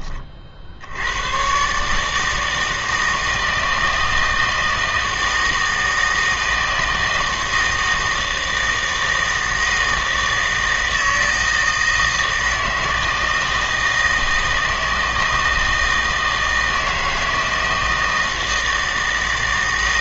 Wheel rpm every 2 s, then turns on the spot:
60, 160, 160, 160, 160, 160, 160, 160, 160, 160.
none